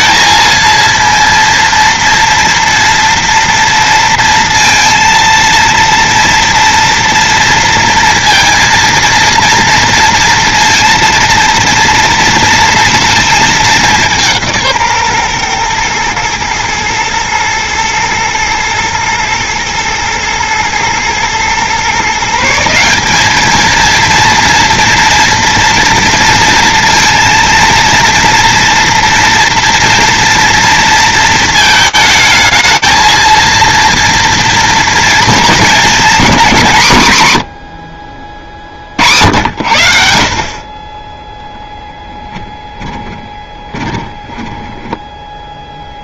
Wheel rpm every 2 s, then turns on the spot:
230, 230, 230, 230, 230, 230, 230, 150, 120, 110, 120, 180, 230, 230, 230, 230, 220, 230, 180, 60, 30, 20, 20.
42-46